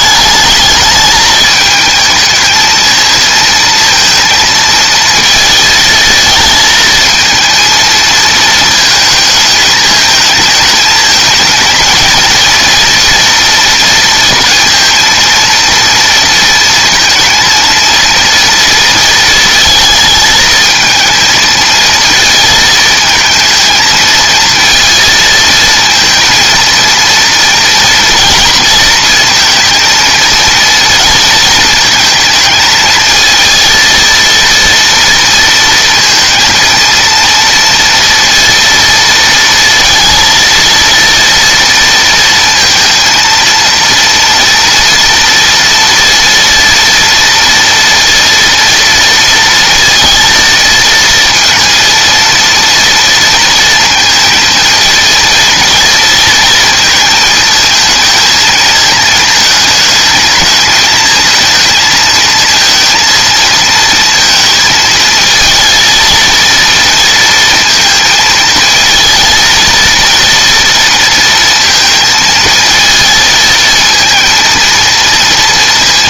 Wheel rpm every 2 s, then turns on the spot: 210, 220, 230, 220, 220, 210, 230, 230, 230, 230, 220, 220, 220, 230, 230, 230, 220, 230, 230, 230, 230, 230, 240, 230, 230, 230, 230, 230, 230, 220, 220, 230, 230, 230, 220, 230, 230, 230.
none